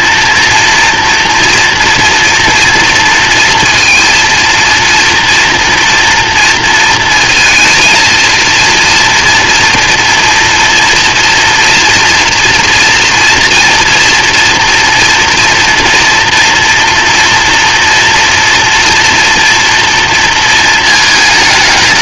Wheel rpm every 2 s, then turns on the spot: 230, 230, 230, 230, 230, 230, 240, 230, 240, 230, 230.
none